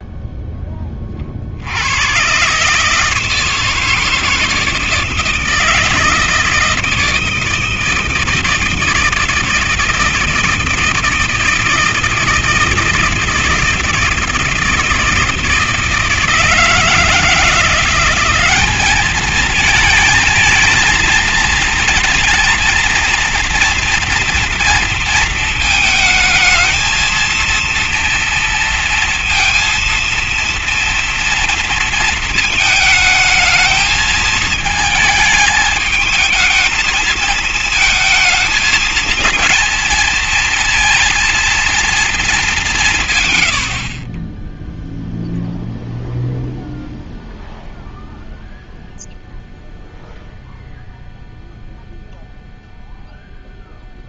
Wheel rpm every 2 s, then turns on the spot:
0, 130, 160, 160, 160, 170, 160, 160, 160, 200, 220, 230, 230, 230, 230, 230, 220, 220, 220, 220, 230, 220, 10, 0, 0, 0, 0.
none